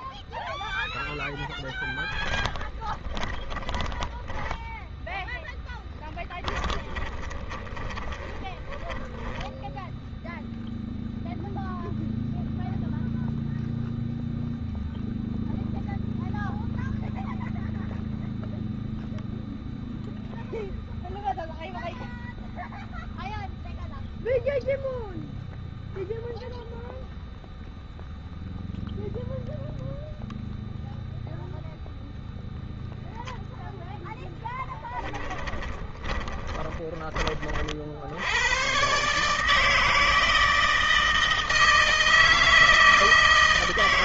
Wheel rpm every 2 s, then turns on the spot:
0, 10, 10, 10, 10, 0, 0, 0, 0, 0, 0, 0, 0, 0, 0, 0, 0, 10, 20, 100, 160, 160.
2-10 34-38